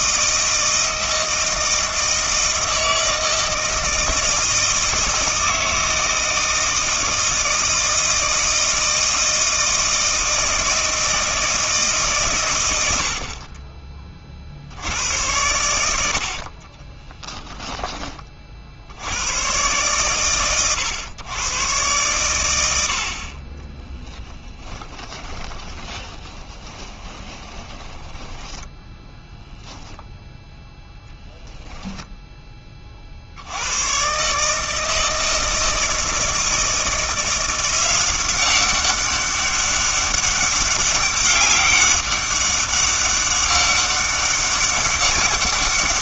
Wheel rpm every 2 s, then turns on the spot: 160, 160, 160, 160, 160, 160, 90, 80, 30, 70, 120, 70, 10, 10, 10, 0, 30, 160, 170, 190, 200, 200, 200.
16-18 26-30